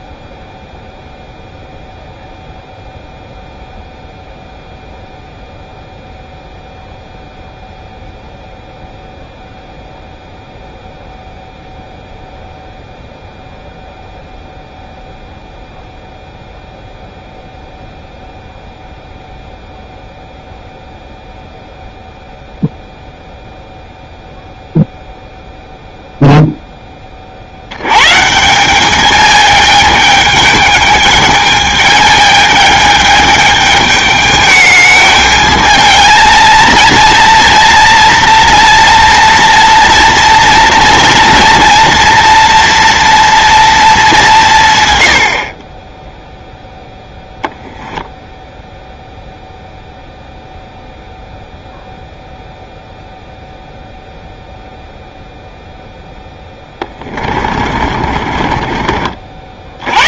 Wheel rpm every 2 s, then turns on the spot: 0, 0, 0, 0, 0, 0, 0, 0, 0, 0, 0, 0, 0, 0, 180, 210, 210, 210, 230, 230, 230, 230, 160, 0, 0, 0, 0, 0, 10, 40.
56-60